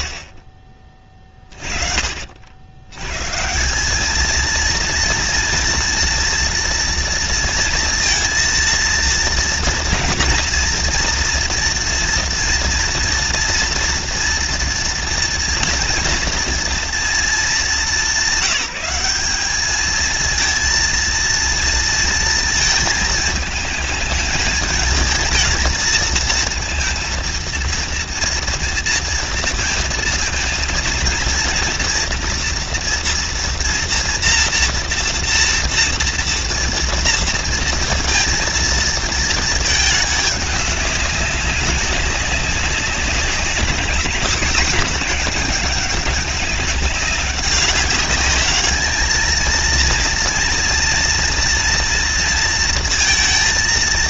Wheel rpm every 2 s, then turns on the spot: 30, 200, 230, 230, 230, 230, 230, 230, 210, 210, 230, 220, 220, 230, 230, 240, 230, 240, 230, 220, 200, 190, 190, 200, 230, 230, 230.
none